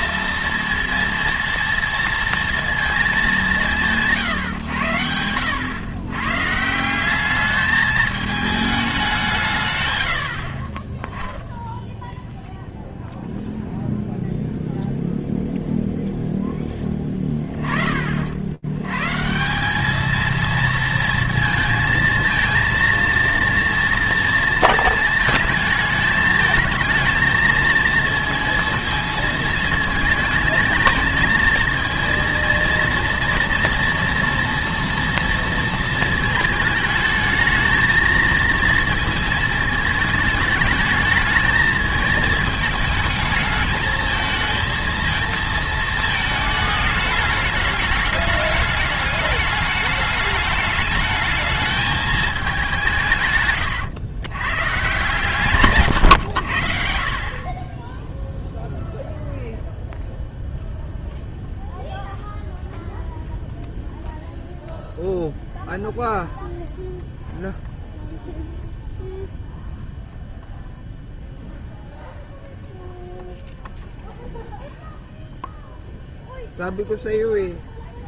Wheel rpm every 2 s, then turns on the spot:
230, 230, 110, 160, 210, 40, 0, 0, 10, 90, 230, 230, 230, 220, 230, 220, 230, 230, 220, 230, 220, 220, 220, 220, 210, 210, 190, 140, 70, 0, 0, 0, 0, 0, 0, 0, 0, 0, 0.
none